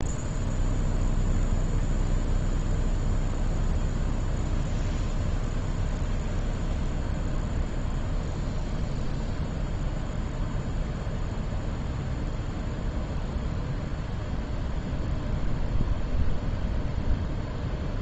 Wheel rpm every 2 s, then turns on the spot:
0, 0, 0, 0, 0, 0, 0, 0, 0.
none